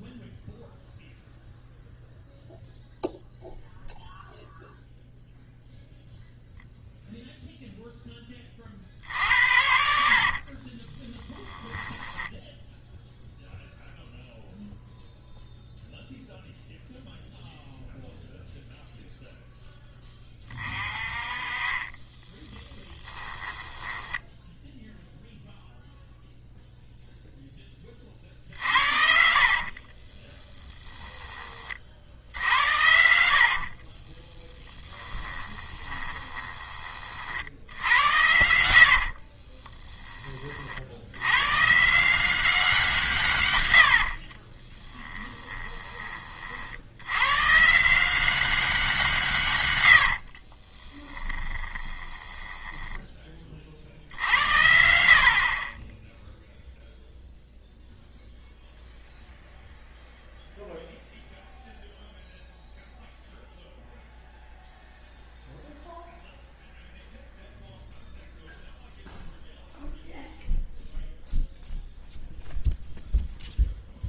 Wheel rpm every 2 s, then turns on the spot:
0, 0, 0, 0, 40, 30, 0, 0, 0, 0, 30, 10, 0, 0, 50, 10, 80, 10, 20, 80, 60, 180, 30, 60, 190, 30, 10, 80, 0, 0, 0, 0, 0, 0, 0, 0, 0.
10-12 22-24 34-36 38-40 44-46 50-54